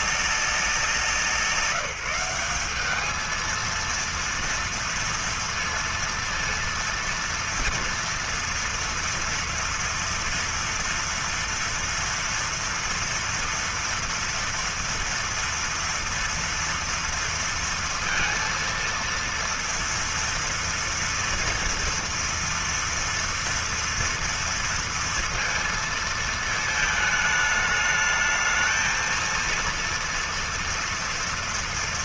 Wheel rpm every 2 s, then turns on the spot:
190, 180, 230, 230, 230, 230, 230, 230, 230, 230, 230, 230, 230, 220, 220, 230.
none